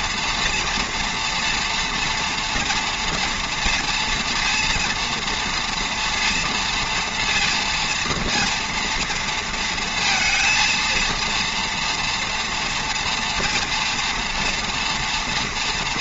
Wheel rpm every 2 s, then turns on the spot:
230, 230, 230, 230, 230, 230, 240, 240.
none